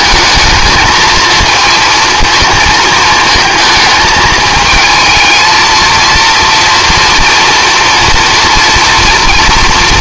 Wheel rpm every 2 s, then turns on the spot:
220, 220, 220, 230, 230.
none